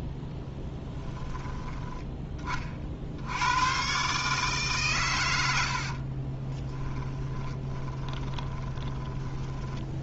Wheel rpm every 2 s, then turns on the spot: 10, 40, 130, 20, 20.
6-10